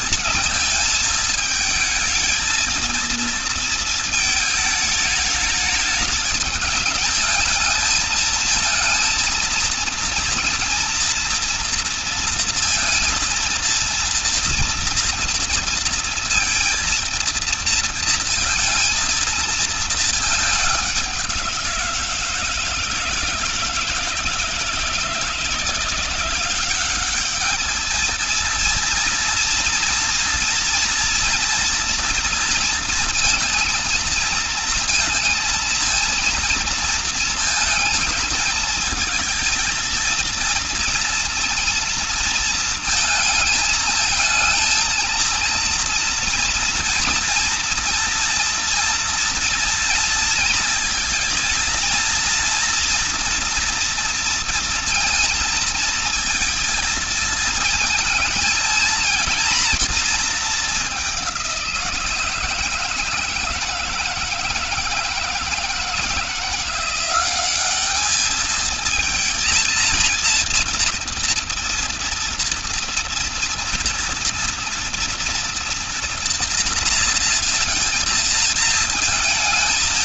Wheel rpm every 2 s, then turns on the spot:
220, 230, 210, 210, 220, 230, 230, 230, 230, 230, 200, 160, 160, 190, 230, 230, 230, 220, 230, 230, 230, 230, 220, 240, 240, 230, 230, 230, 220, 220, 210, 170, 160, 180, 220, 230, 230, 230, 230, 220.
none